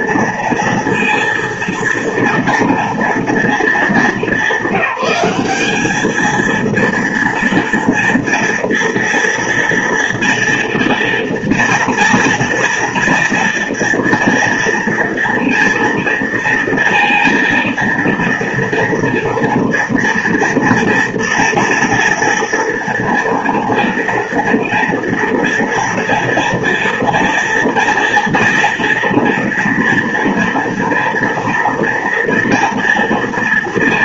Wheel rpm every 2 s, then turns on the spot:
230, 230, 200, 230, 230, 230, 230, 230, 230, 230, 240, 230, 230, 230, 230, 230, 230.
none